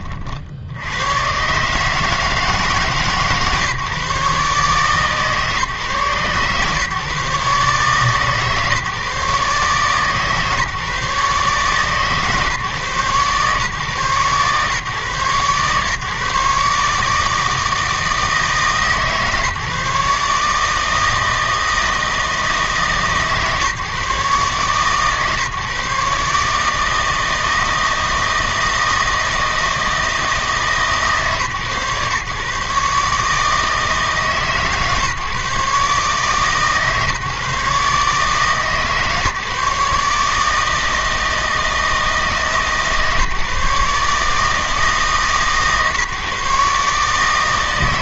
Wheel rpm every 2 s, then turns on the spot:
70, 150, 140, 130, 140, 150, 140, 140, 150, 150, 150, 150, 130, 150, 160, 160, 140, 140, 140, 150, 150, 150, 160, 140.
none